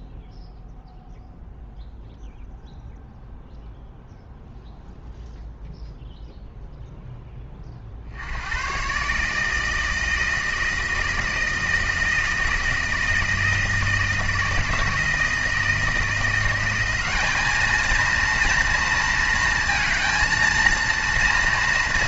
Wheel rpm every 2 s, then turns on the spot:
0, 0, 0, 0, 130, 160, 160, 160, 180, 230, 230.
none